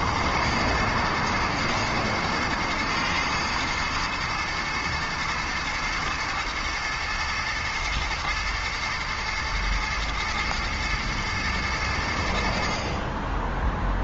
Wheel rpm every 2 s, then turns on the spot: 120, 110, 120, 110, 120, 120, 50.
none